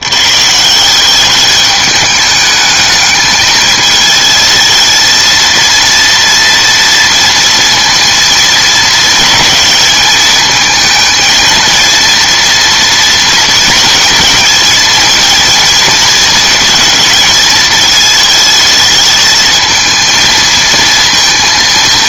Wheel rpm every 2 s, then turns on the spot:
130, 210, 220, 230, 230, 220, 230, 220, 220, 220, 230.
none